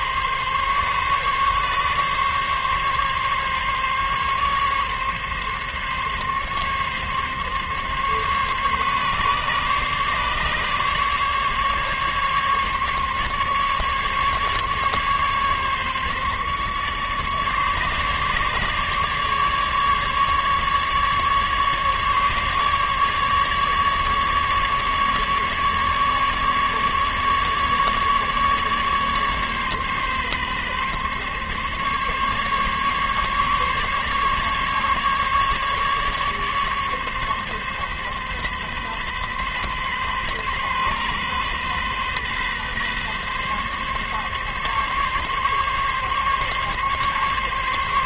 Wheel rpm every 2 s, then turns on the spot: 140, 140, 140, 140, 140, 150, 140, 140, 150, 150, 140, 150, 150, 150, 140, 140, 140, 140, 140, 140, 130, 140, 140, 140.
none